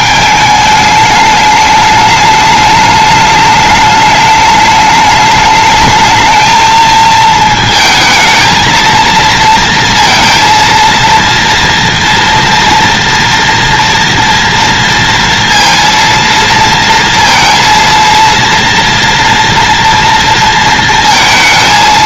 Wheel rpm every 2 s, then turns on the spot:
210, 210, 210, 220, 230, 230, 230, 230, 230, 230, 230.
none